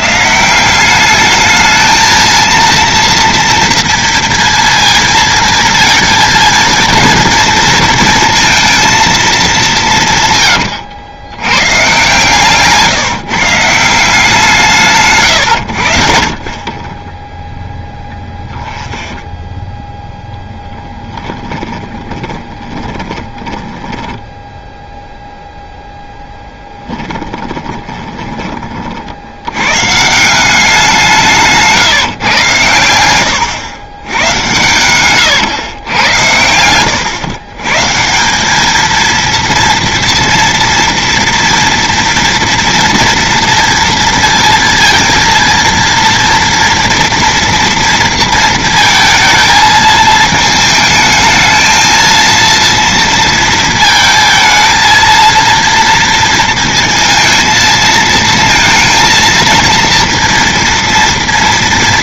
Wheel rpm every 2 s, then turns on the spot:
190, 230, 230, 230, 230, 110, 150, 160, 30, 10, 10, 10, 0, 10, 40, 180, 110, 100, 100, 220, 230, 230, 230, 240, 230, 220, 230, 220, 230, 220, 230.
10-12 18-24 26-28 34-38